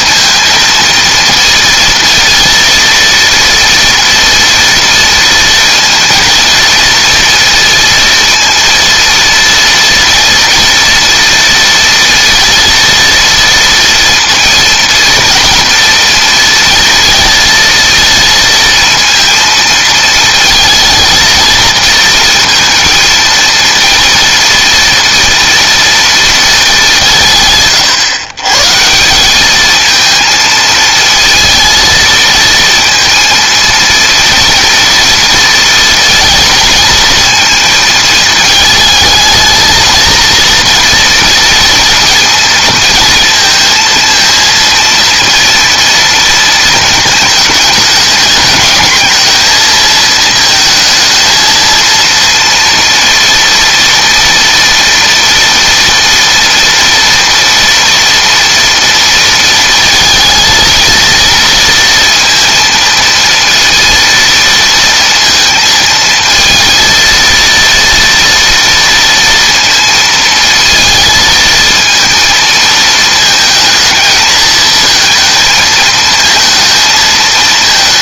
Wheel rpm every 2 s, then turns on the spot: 230, 230, 230, 230, 230, 240, 230, 230, 230, 230, 230, 230, 230, 220, 130, 220, 230, 230, 230, 220, 230, 230, 230, 230, 210, 220, 230, 230, 230, 230, 230, 230, 230, 220, 230, 230, 230, 220, 230.
none